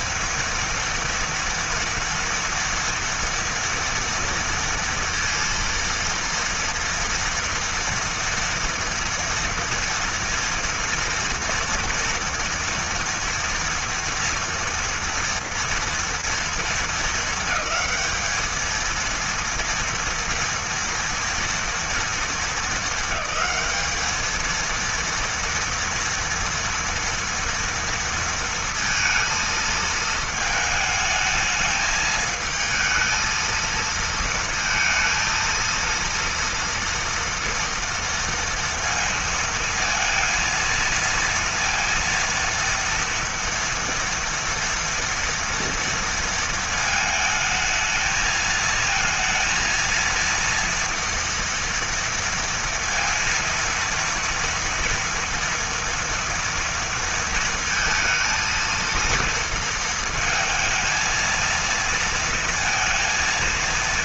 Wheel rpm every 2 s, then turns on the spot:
230, 230, 230, 230, 240, 230, 230, 230, 220, 230, 230, 220, 230, 230, 230, 220, 230, 230, 230, 230, 230, 230, 230, 220, 230, 230, 230, 240, 230, 230, 230, 230.
none